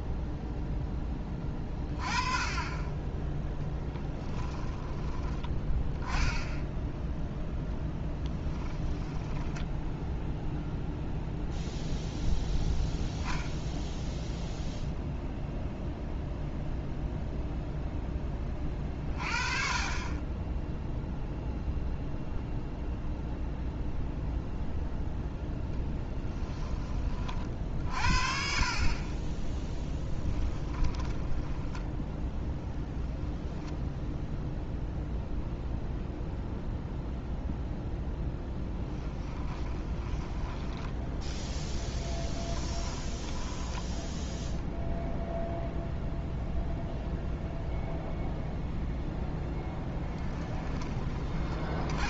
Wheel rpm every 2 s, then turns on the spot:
10, 30, 10, 0, 10, 0, 0, 0, 0, 30, 0, 0, 0, 20, 40, 10, 0, 0, 0, 10, 10, 10, 0, 0, 0, 20.
4-6 8-10 30-32 38-44